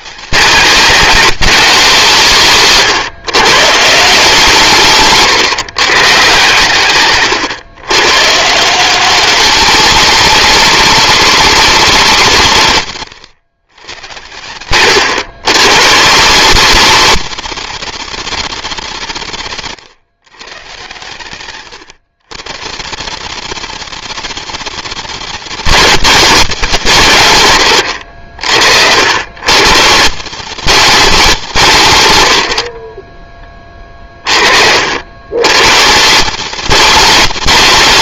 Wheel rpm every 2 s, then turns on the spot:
190, 140, 150, 120, 170, 190, 120, 100, 180, 180, 110, 140, 190, 170, 80, 180, 40, 60, 190.
none